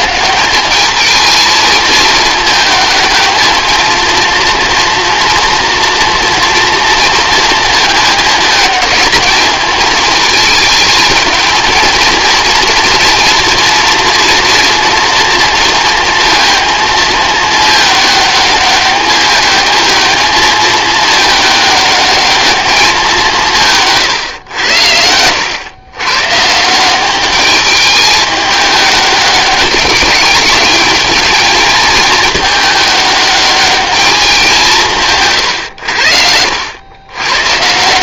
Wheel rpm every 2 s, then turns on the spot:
210, 220, 230, 230, 210, 220, 230, 230, 230, 210, 220, 210, 90, 170, 210, 210, 210, 170, 90.
none